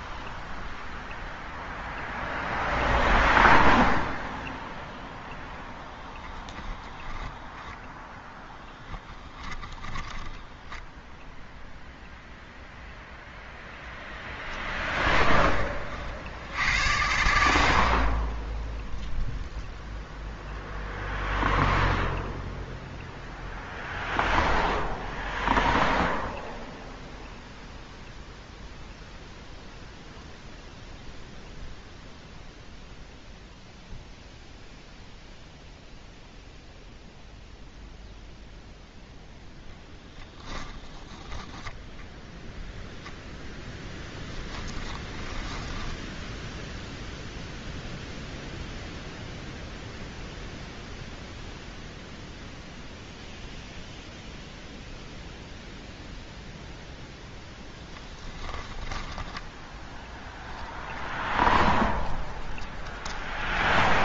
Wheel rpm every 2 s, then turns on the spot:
0, 0, 0, 10, 10, 10, 0, 20, 90, 0, 0, 0, 0, 0, 0, 0, 0, 0, 0, 0, 20, 0, 20, 0, 0, 0, 0, 0, 0, 10, 0, 10.
8-12 14-16 40-42 44-46 58-60 62-64